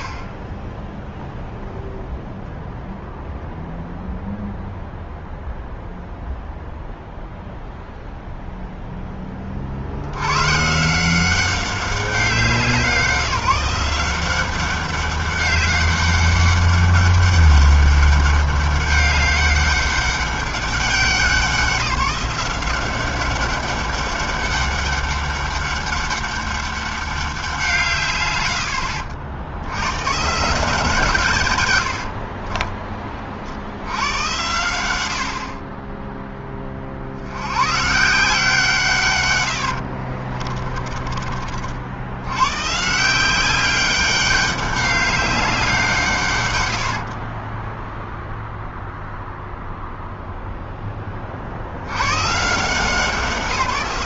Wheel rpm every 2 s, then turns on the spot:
0, 0, 0, 0, 70, 190, 180, 200, 200, 200, 180, 200, 200, 150, 90, 100, 70, 20, 140, 100, 60, 190, 180, 10, 0, 30, 180.
30-32 38-40 46-48